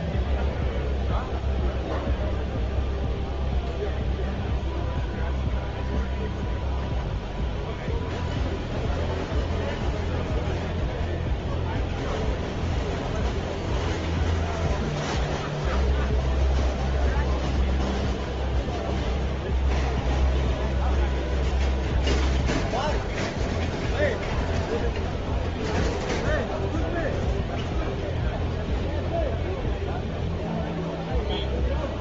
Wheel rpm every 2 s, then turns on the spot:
0, 0, 0, 0, 0, 0, 0, 0, 0, 0, 0, 0, 0, 0, 0, 0.
none